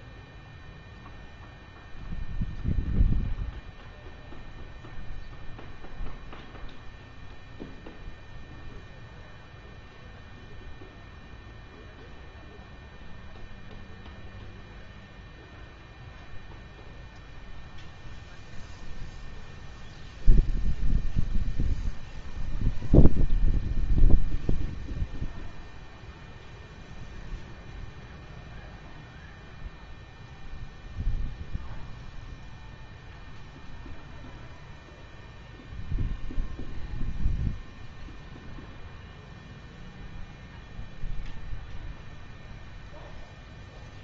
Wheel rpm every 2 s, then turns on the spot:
0, 0, 0, 0, 0, 0, 0, 0, 0, 0, 0, 0, 0, 0, 0, 0, 0, 0, 0, 0, 0, 0.
none